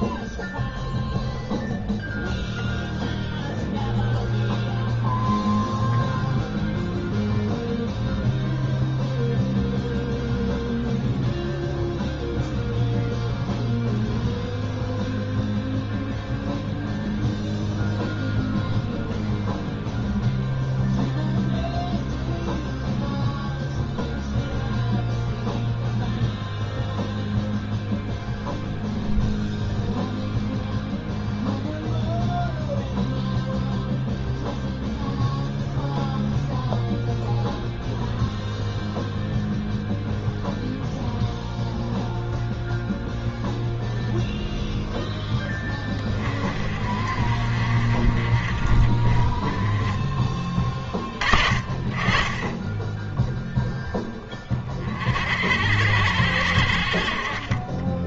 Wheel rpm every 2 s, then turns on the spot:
0, 0, 0, 0, 0, 0, 0, 0, 0, 0, 0, 0, 0, 0, 0, 0, 0, 0, 0, 0, 0, 0, 0, 40, 40, 30, 10, 30, 70.
none